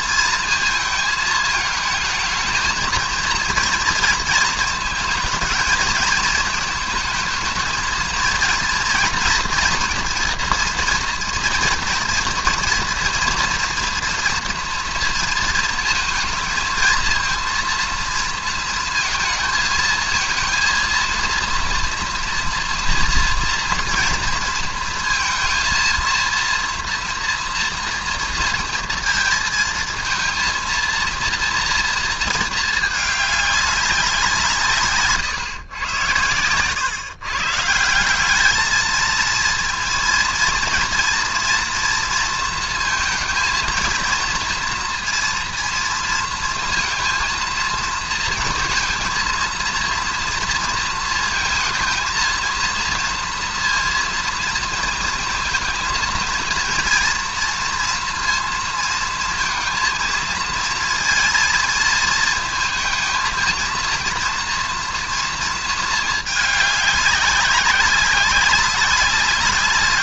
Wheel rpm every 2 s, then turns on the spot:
220, 220, 220, 220, 230, 230, 230, 230, 230, 220, 230, 230, 230, 240, 230, 230, 210, 140, 130, 220, 230, 230, 230, 230, 220, 230, 230, 230, 230, 230, 230, 230, 230, 200, 200.
none